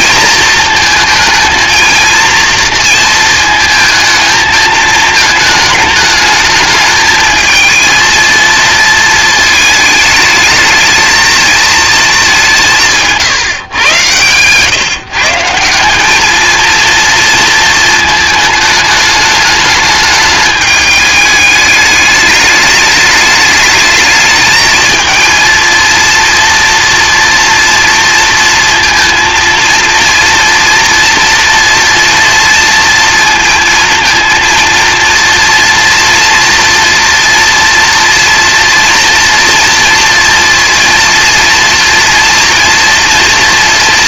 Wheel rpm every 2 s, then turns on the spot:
220, 230, 220, 220, 230, 220, 160, 140, 230, 210, 210, 210, 220, 230, 230, 230, 230, 230, 230, 230, 230, 240.
12-14